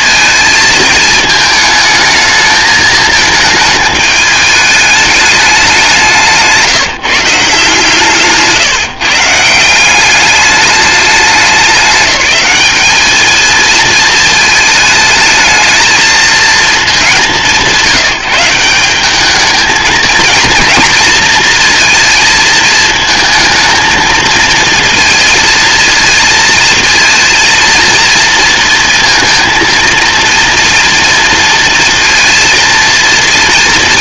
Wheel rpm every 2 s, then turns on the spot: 220, 220, 210, 170, 150, 200, 190, 220, 230, 180, 230, 230, 220, 220, 230, 230, 230.
8-10